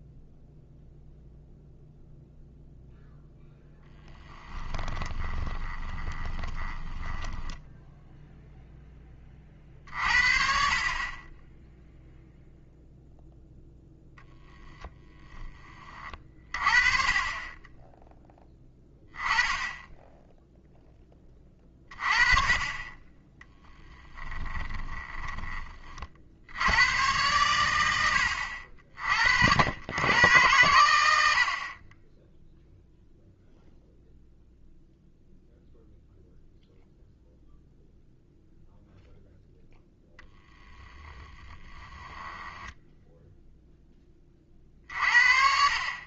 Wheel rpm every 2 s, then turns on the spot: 0, 0, 20, 10, 10, 40, 0, 10, 30, 20, 10, 30, 10, 100, 60, 100, 0, 0, 0, 0, 10, 10, 50.
4-8 24-26 40-44